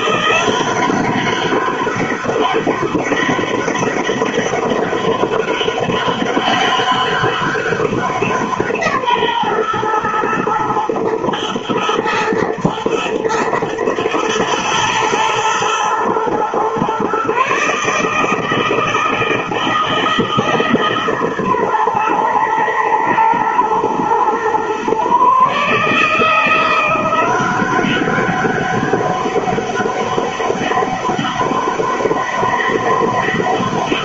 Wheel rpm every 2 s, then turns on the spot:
190, 200, 200, 190, 150, 120, 120, 120, 130, 160, 150, 110, 130, 170, 200, 200, 200.
none